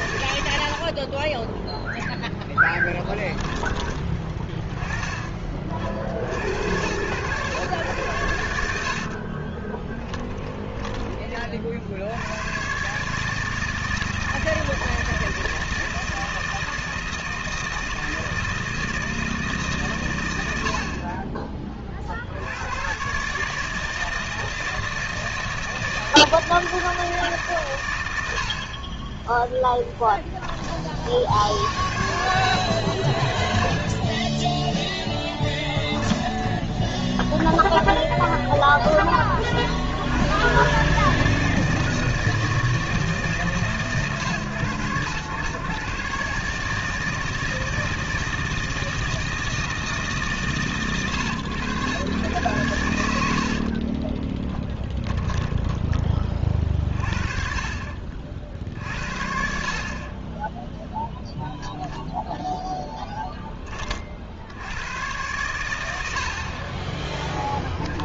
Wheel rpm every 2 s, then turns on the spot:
40, 10, 30, 120, 50, 30, 150, 160, 160, 160, 40, 140, 160, 160, 20, 50, 40, 0, 10, 20, 150, 160, 110, 160, 160, 120, 80, 10, 50, 70, 0, 10, 110, 10.
0-2 8-10 36-38 54-56 66-68